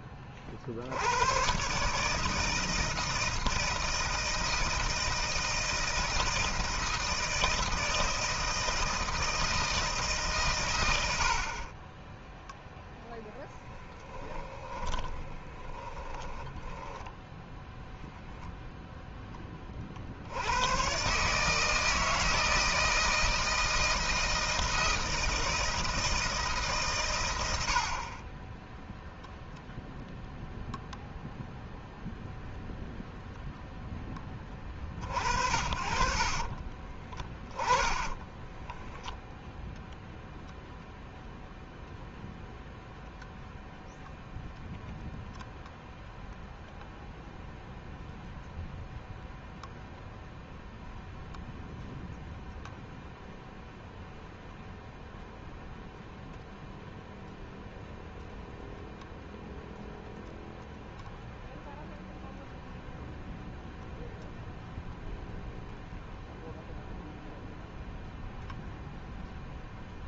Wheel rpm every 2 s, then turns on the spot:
60, 160, 160, 160, 160, 100, 0, 20, 10, 0, 110, 160, 160, 140, 10, 0, 0, 40, 40, 10, 0, 0, 0, 0, 0, 0, 0, 0, 0, 0, 0, 0, 0, 0, 0.
14-18 36-40